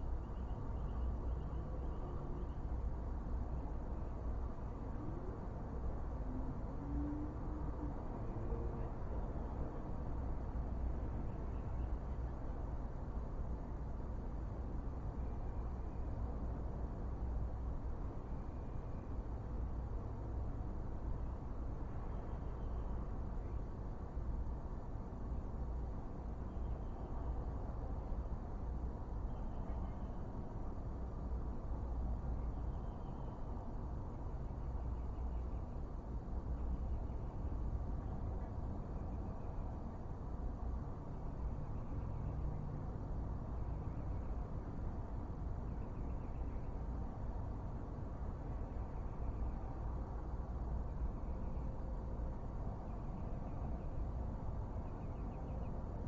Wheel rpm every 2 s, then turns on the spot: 0, 0, 0, 0, 0, 0, 0, 0, 0, 0, 0, 0, 0, 0, 0, 0, 0, 0, 0, 0, 0, 0, 0, 0, 0, 0, 0, 0.
none